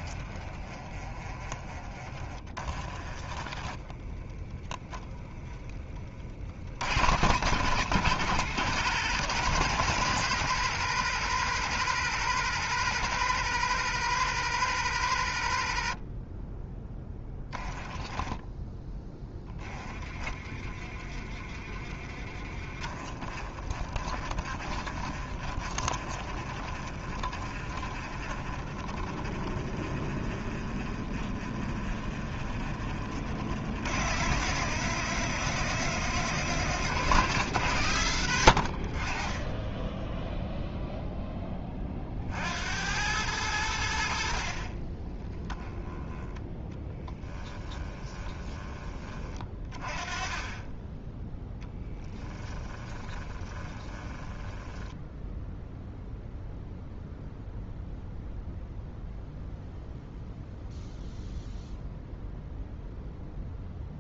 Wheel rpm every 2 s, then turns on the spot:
30, 30, 20, 70, 110, 120, 120, 120, 10, 10, 30, 30, 40, 40, 40, 40, 40, 120, 120, 60, 0, 80, 30, 10, 20, 10, 20, 10, 0, 0, 0, 0.
0-4 18-20 22-34 46-48 52-56